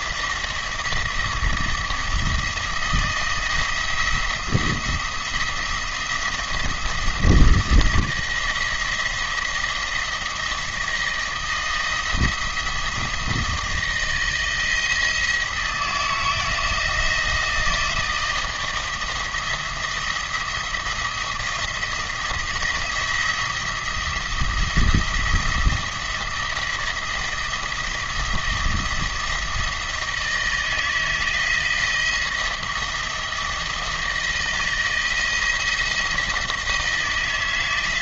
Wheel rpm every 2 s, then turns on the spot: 170, 170, 170, 170, 170, 170, 170, 160, 160, 160, 170, 170, 170, 160, 170, 160, 170, 160, 160.
none